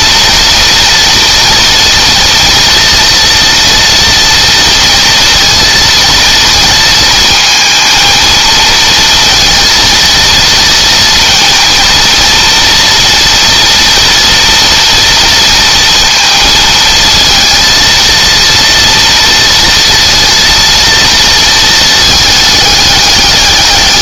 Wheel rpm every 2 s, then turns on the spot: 230, 230, 230, 220, 230, 230, 230, 230, 220, 230, 230, 210.
none